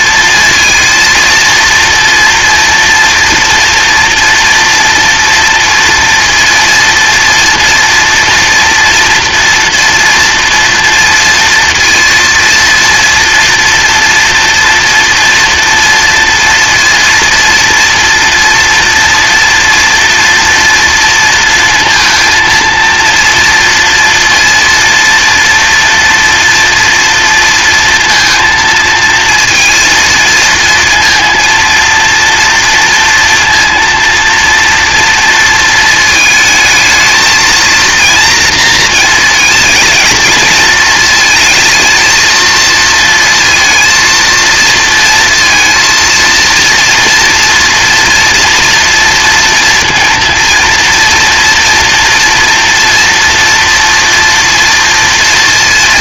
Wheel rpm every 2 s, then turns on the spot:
230, 230, 230, 240, 230, 230, 230, 230, 230, 230, 230, 230, 240, 230, 230, 230, 230, 240, 220, 230, 220, 230, 230, 230, 230, 230, 230, 230.
none